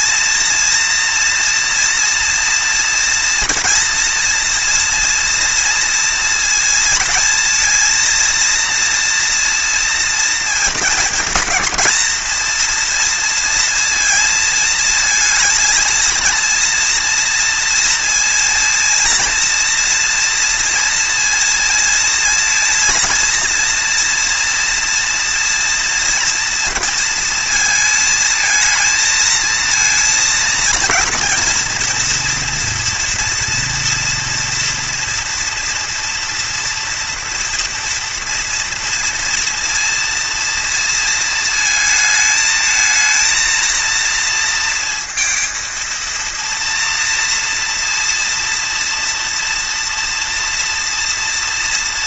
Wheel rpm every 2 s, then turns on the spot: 230, 230, 230, 230, 230, 220, 230, 220, 230, 230, 230, 230, 230, 230, 230, 230, 230, 230, 230, 230, 230, 220, 230, 230, 230, 230.
none